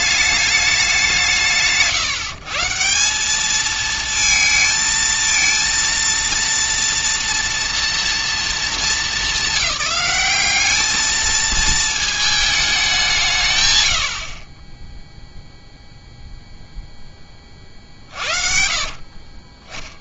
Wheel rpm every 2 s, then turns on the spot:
200, 160, 220, 230, 220, 200, 210, 20, 0, 50.
none